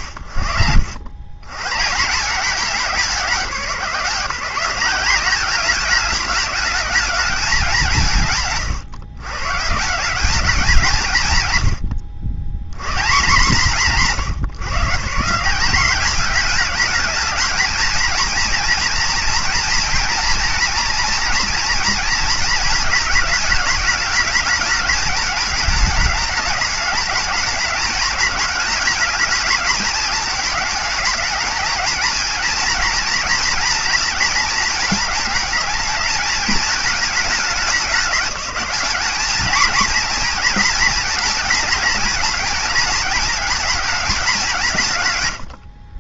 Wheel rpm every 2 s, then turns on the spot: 100, 170, 200, 180, 120, 110, 130, 180, 220, 230, 230, 220, 220, 210, 210, 220, 240, 220, 210, 210, 230, 220, 120.
none